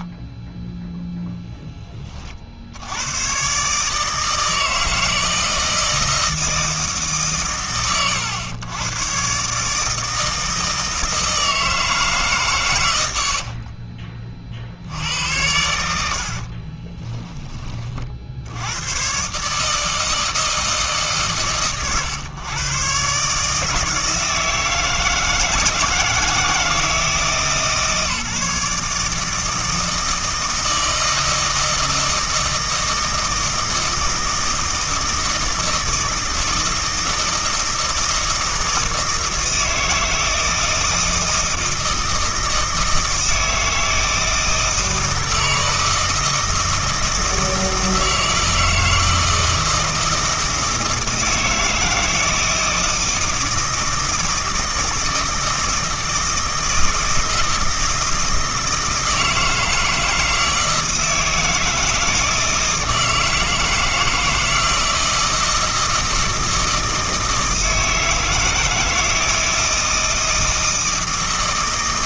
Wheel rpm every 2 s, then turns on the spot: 0, 80, 160, 160, 120, 160, 110, 60, 30, 100, 160, 130, 160, 160, 150, 160, 160, 160, 160, 160, 160, 160, 160, 160, 160, 160, 160, 160, 160, 160, 160, 160, 160, 160, 160, 160.
16-18